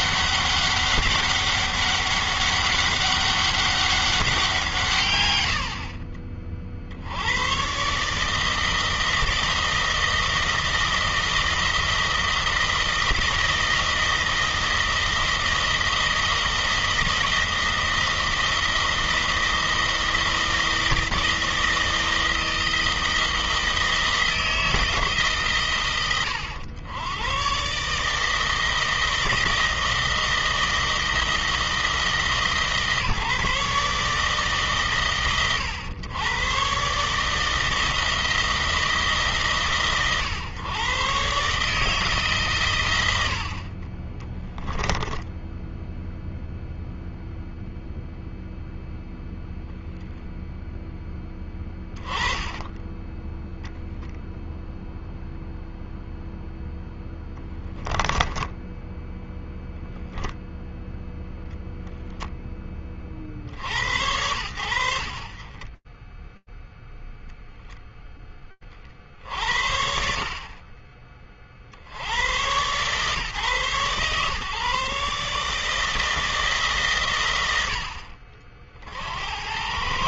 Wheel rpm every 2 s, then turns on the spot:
200, 200, 140, 70, 160, 160, 160, 160, 160, 160, 160, 160, 150, 100, 160, 160, 150, 120, 140, 140, 130, 100, 10, 0, 0, 10, 20, 0, 10, 10, 0, 10, 60, 0, 40, 30, 120, 140, 120, 80.
52-54